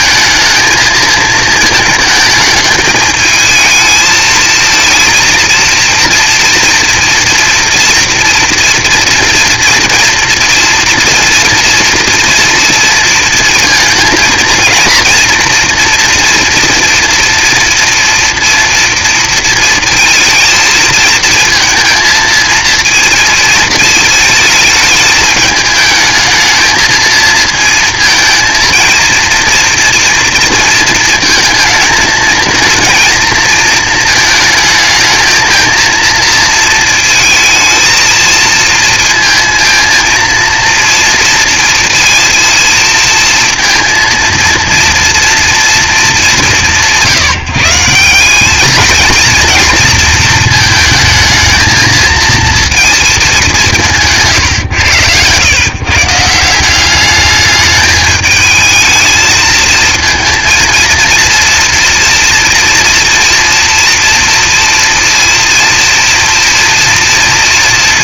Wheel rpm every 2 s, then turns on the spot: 220, 220, 220, 230, 230, 230, 230, 230, 240, 230, 220, 220, 210, 220, 230, 230, 220, 220, 230, 230, 230, 230, 230, 180, 210, 220, 230, 140, 180, 220, 230, 230, 230, 230.
54-56